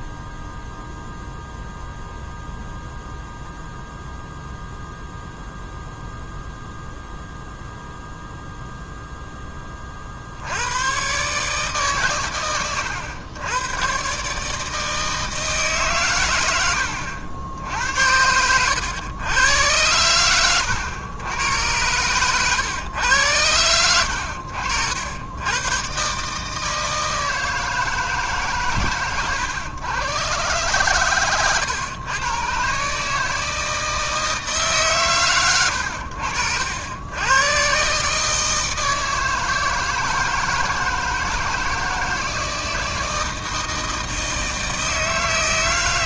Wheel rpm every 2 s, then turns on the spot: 0, 0, 0, 0, 0, 80, 110, 150, 100, 90, 100, 120, 70, 150, 130, 120, 130, 160, 80, 160, 160, 160, 160.
20-22 24-26